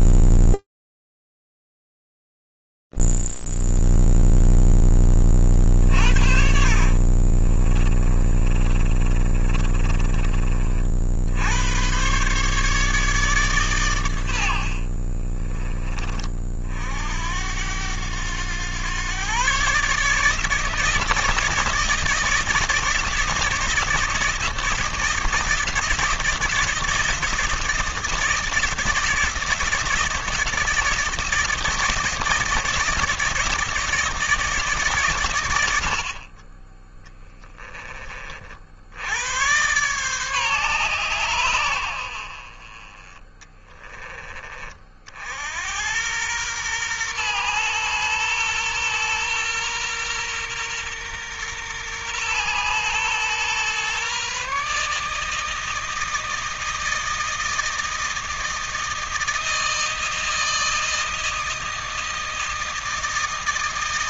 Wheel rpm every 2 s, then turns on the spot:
0, 0, 0, 50, 30, 30, 120, 110, 30, 100, 150, 160, 160, 160, 160, 160, 170, 150, 30, 60, 130, 40, 30, 110, 120, 120, 120, 140, 160, 160, 160, 160.
6-12